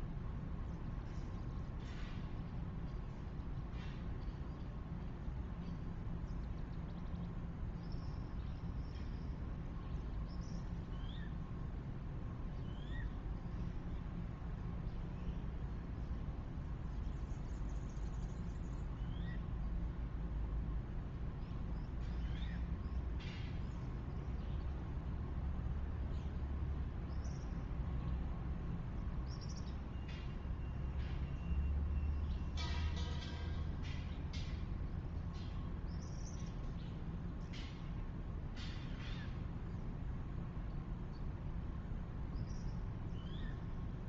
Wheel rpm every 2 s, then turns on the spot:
0, 0, 0, 0, 0, 0, 0, 0, 0, 0, 0, 0, 0, 0, 0, 0, 0, 0, 0, 0, 0, 0.
none